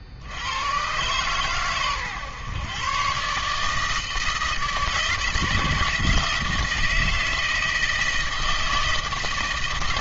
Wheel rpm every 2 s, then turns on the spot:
50, 130, 160, 160, 160.
none